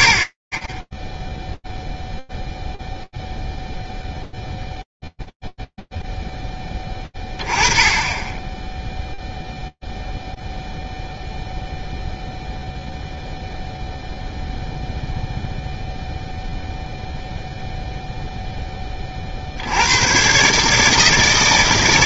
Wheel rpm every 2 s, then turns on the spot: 10, 0, 0, 0, 10, 0, 0, 0, 0, 60, 160.
none